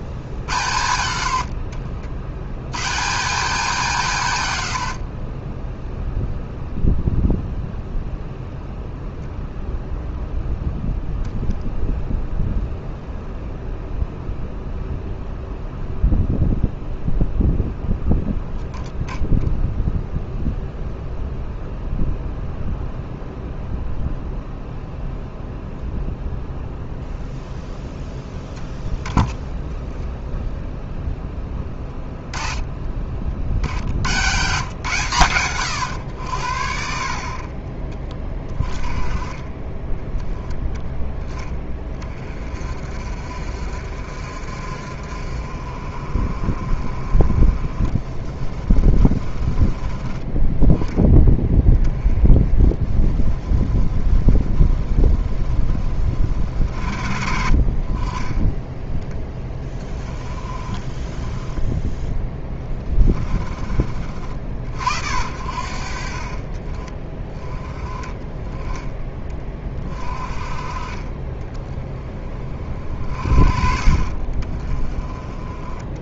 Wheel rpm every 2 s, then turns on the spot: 100, 130, 110, 0, 10, 10, 0, 0, 0, 0, 0, 0, 0, 0, 0, 0, 20, 130, 60, 20, 10, 40, 50, 40, 30, 10, 20, 20, 60, 10, 20, 20, 50, 30, 20, 40, 40, 20.
none